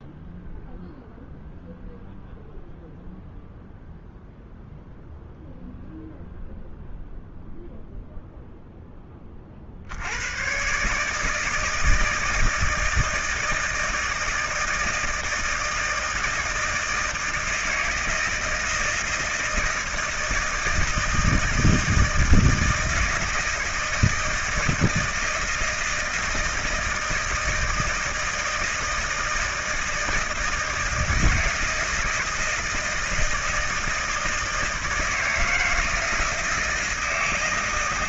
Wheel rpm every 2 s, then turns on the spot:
0, 0, 0, 0, 10, 130, 160, 160, 160, 160, 160, 160, 160, 160, 160, 160, 160, 160, 160.
none